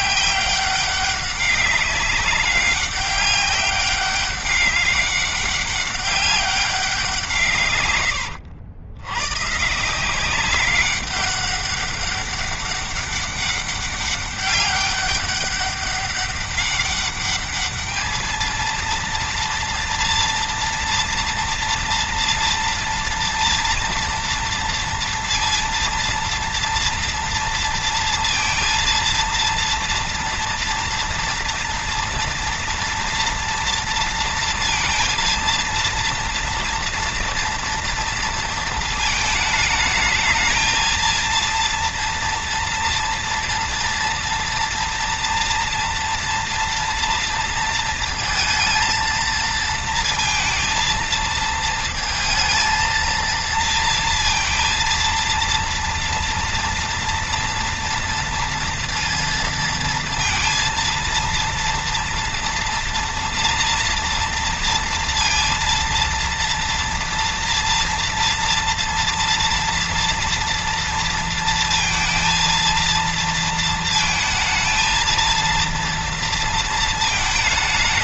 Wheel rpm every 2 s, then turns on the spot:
200, 190, 200, 160, 110, 190, 200, 200, 200, 230, 230, 230, 230, 230, 230, 240, 230, 230, 230, 220, 230, 230, 240, 230, 230, 230, 230, 230, 230, 230, 230, 230, 230, 230, 230, 230, 230, 230, 220.
none